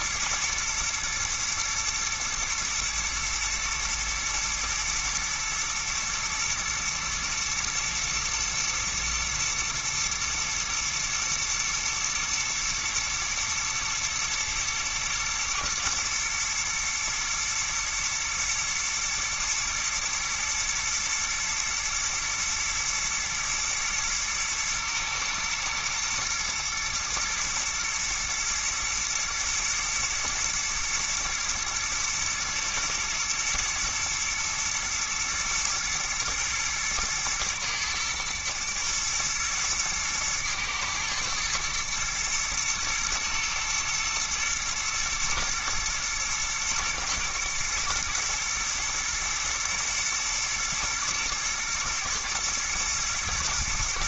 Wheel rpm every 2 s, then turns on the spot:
110, 110, 120, 110, 120, 120, 120, 110, 110, 110, 120, 110, 110, 110, 120, 120, 110, 110, 110, 110, 110, 110, 110, 110, 110, 110, 120.
none